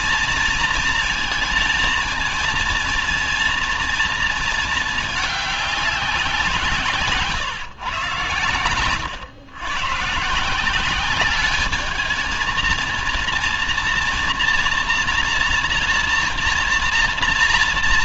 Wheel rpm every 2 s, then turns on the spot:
230, 230, 220, 160, 120, 170, 220, 240, 240.
none